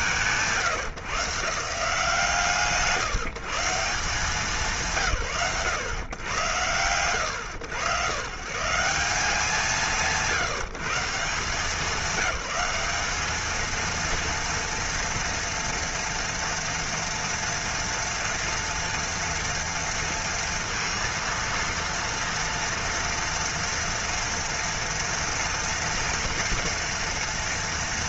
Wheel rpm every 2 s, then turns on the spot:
120, 160, 140, 80, 160, 160, 210, 230, 230, 240, 230, 230, 230, 230.
none